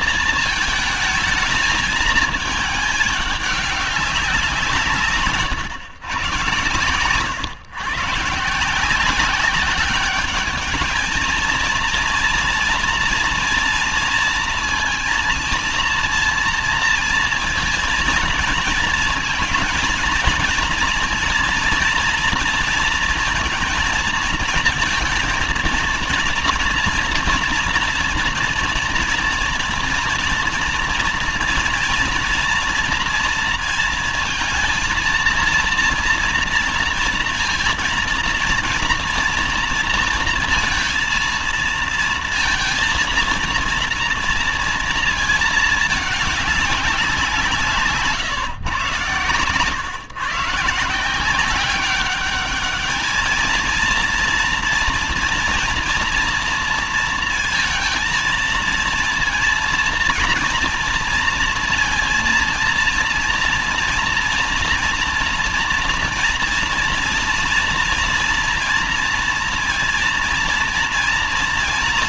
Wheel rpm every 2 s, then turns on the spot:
230, 220, 170, 120, 160, 210, 230, 230, 230, 230, 230, 230, 230, 240, 230, 230, 230, 230, 230, 230, 230, 230, 230, 200, 120, 170, 210, 230, 230, 230, 230, 230, 230, 230, 230, 230.
none